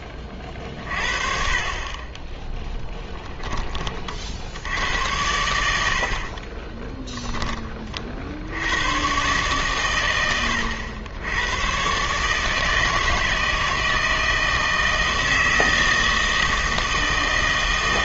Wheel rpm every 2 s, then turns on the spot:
40, 10, 80, 30, 80, 90, 160, 160, 160.
2-4 6-8